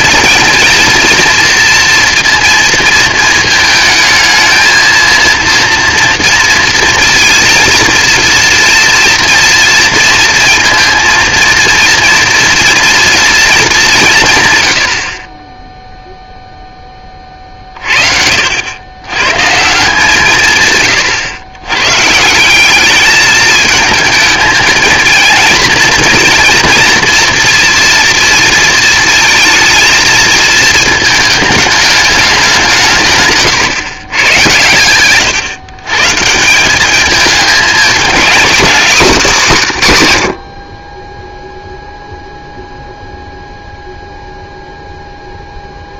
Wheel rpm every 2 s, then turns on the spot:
230, 230, 220, 230, 230, 230, 240, 130, 0, 70, 150, 190, 220, 230, 230, 220, 180, 120, 170, 240, 50, 0, 0.
34-36